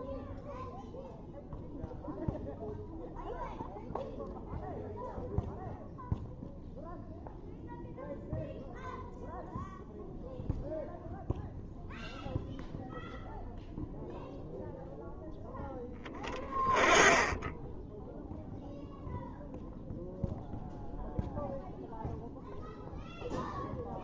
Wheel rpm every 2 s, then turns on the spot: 0, 0, 0, 0, 0, 0, 0, 0, 10, 0, 0, 0.
none